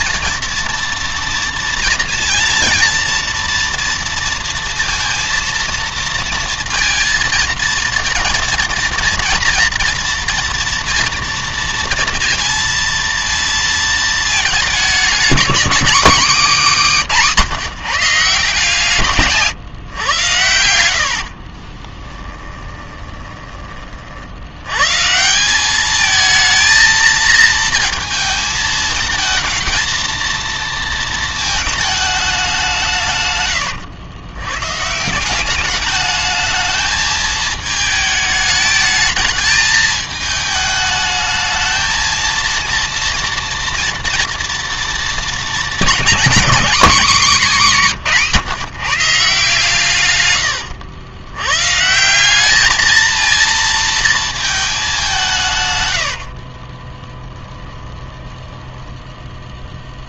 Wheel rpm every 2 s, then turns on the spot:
230, 230, 230, 230, 230, 230, 230, 210, 200, 160, 90, 20, 110, 220, 220, 230, 170, 140, 220, 220, 210, 230, 230, 240, 160, 100, 220, 210, 30, 10.
20-24 56-60